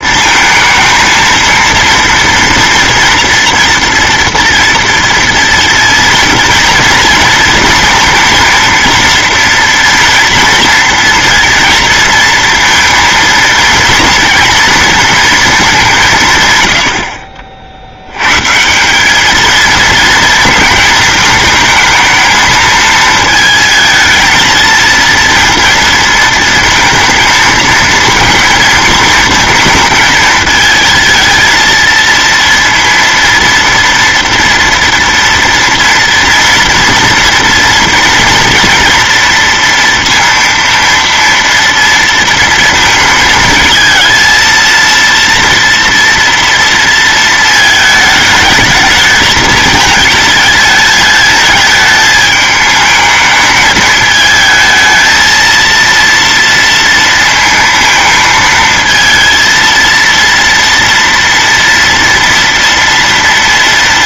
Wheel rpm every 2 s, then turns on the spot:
220, 230, 230, 230, 230, 230, 230, 230, 130, 120, 230, 220, 230, 230, 230, 220, 230, 230, 230, 230, 230, 230, 230, 230, 220, 220, 220, 220, 230, 230, 230, 230.
none